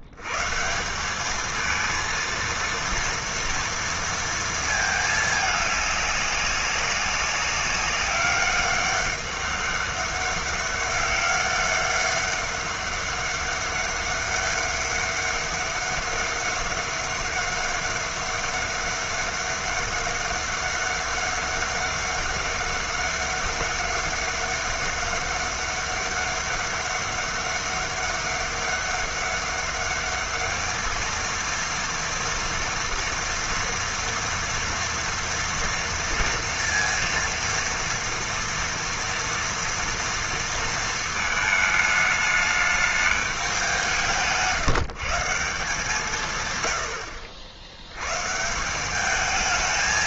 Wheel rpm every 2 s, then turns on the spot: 100, 230, 230, 200, 200, 200, 200, 200, 200, 200, 200, 200, 200, 200, 200, 220, 230, 230, 230, 230, 230, 210, 150, 100, 200.
none